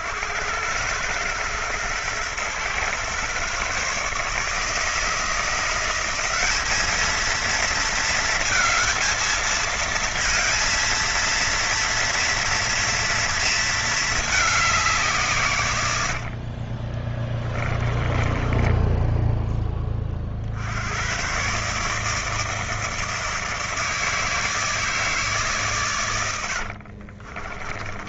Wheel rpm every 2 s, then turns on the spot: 100, 120, 150, 210, 220, 230, 230, 190, 30, 10, 80, 160, 160, 60.
16-20 26-28